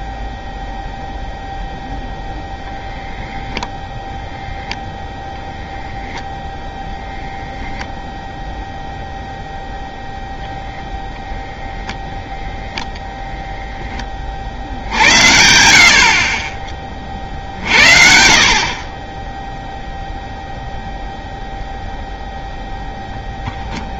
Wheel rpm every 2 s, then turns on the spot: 0, 0, 0, 0, 0, 0, 0, 70, 30, 40, 0, 0.
none